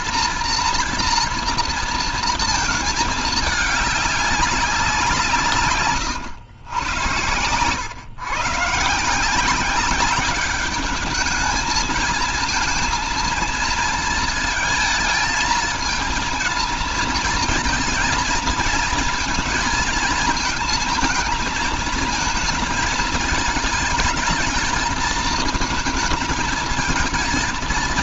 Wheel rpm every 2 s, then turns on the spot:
240, 220, 190, 100, 150, 210, 230, 220, 230, 220, 220, 220, 220, 220.
none